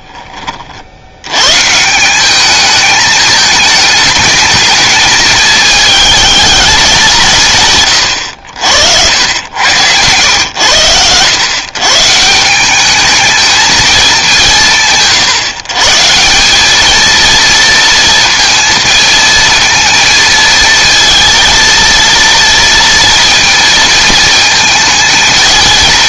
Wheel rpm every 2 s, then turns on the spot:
60, 210, 220, 200, 80, 100, 210, 160, 210, 220, 230, 230, 220.
8-10